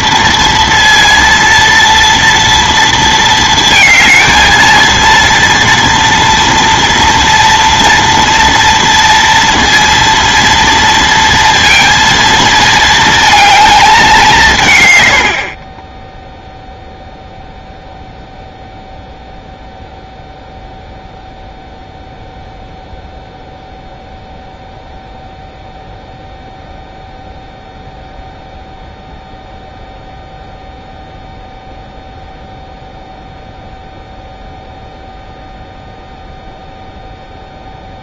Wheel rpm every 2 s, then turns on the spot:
230, 230, 230, 230, 230, 230, 230, 120, 0, 0, 0, 0, 0, 0, 0, 0, 0, 0, 0.
none